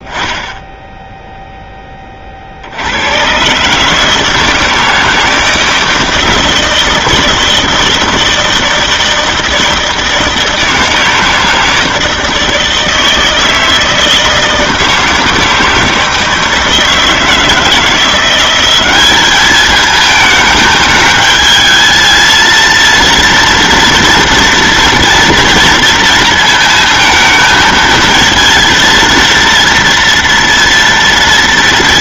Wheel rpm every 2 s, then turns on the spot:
0, 60, 160, 160, 160, 160, 160, 160, 160, 190, 220, 230, 230, 230, 230, 230.
none